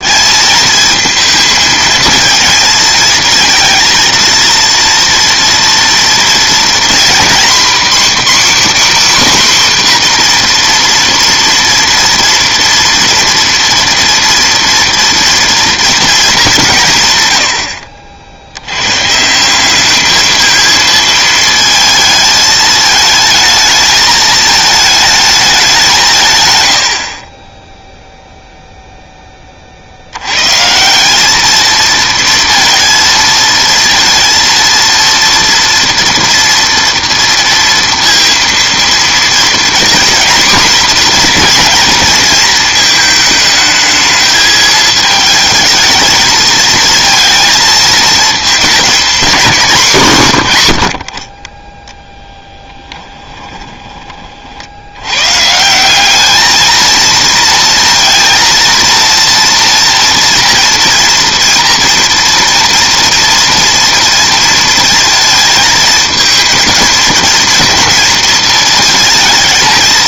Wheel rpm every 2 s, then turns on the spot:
230, 220, 230, 240, 280, 240, 230, 230, 190, 90, 220, 220, 220, 100, 0, 140, 230, 230, 230, 230, 250, 230, 220, 220, 230, 90, 20, 60, 220, 230, 230, 230, 230, 230, 230.
52-54